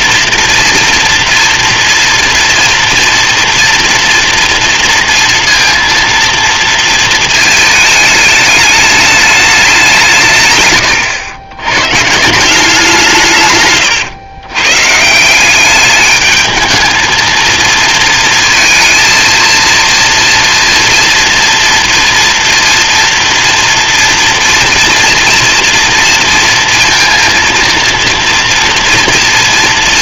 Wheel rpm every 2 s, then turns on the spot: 230, 230, 230, 220, 190, 120, 110, 200, 230, 230, 230, 230, 230, 230, 230.
12-14